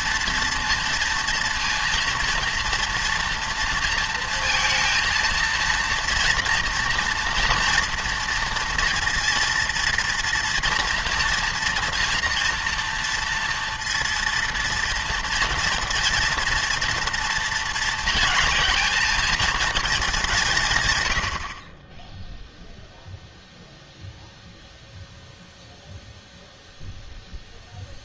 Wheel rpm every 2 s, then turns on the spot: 230, 230, 230, 240, 230, 230, 230, 230, 230, 220, 140, 0, 0, 0.
none